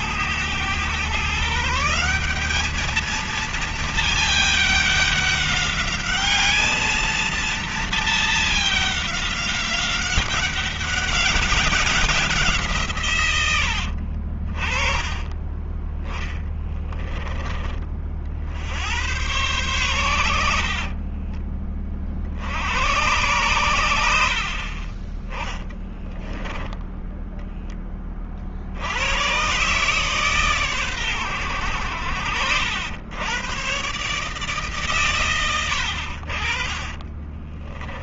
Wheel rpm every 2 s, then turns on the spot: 110, 210, 210, 220, 210, 190, 160, 30, 10, 80, 60, 80, 40, 10, 70, 120, 90, 130, 30.
20-22 26-28 36-38